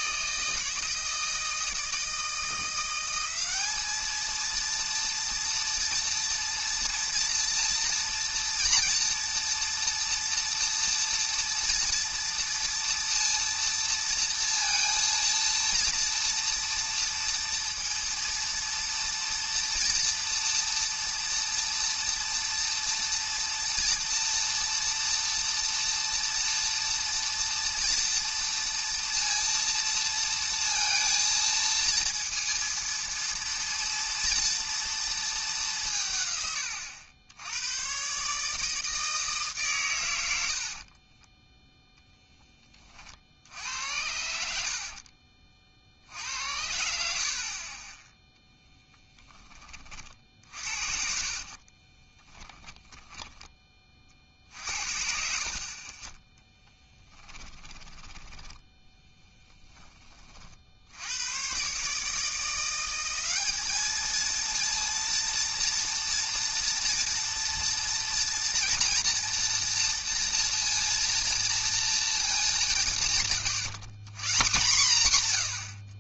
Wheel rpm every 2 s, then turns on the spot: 160, 170, 220, 230, 230, 230, 240, 230, 230, 230, 230, 230, 230, 230, 230, 230, 230, 240, 120, 150, 80, 10, 70, 70, 0, 50, 10, 60, 10, 10, 40, 170, 230, 240, 230, 230, 210, 160.
44-46 50-54 56-58